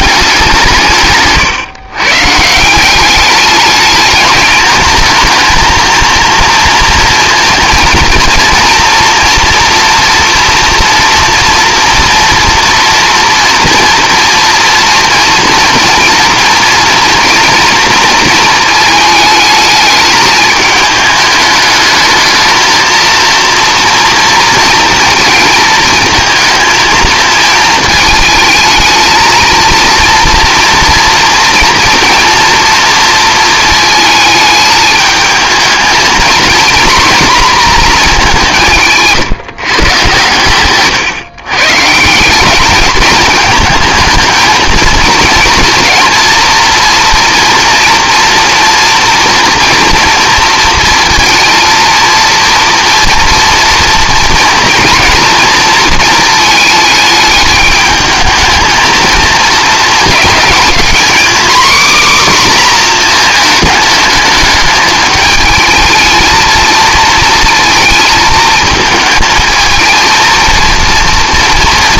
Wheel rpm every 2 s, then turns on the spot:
170, 170, 220, 230, 240, 240, 240, 230, 230, 220, 210, 230, 230, 220, 220, 240, 230, 210, 240, 170, 120, 210, 230, 240, 230, 230, 230, 230, 220, 220, 230, 250, 220, 230, 220, 230.
40-42